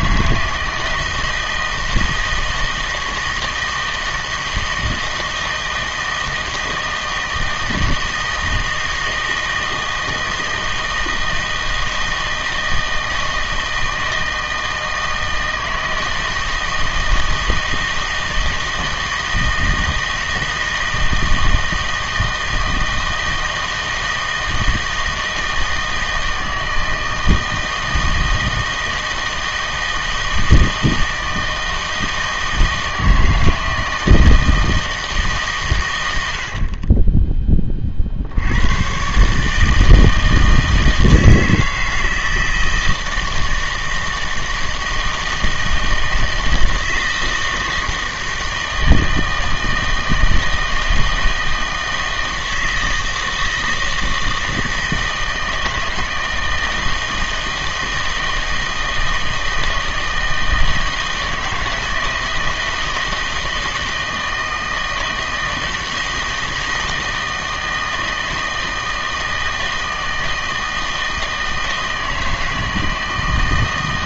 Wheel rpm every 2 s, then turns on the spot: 160, 160, 160, 160, 160, 160, 160, 160, 160, 160, 160, 160, 160, 160, 160, 160, 160, 160, 50, 100, 160, 160, 160, 160, 160, 160, 160, 160, 160, 160, 160, 160, 160, 160, 160, 160, 160.
36-38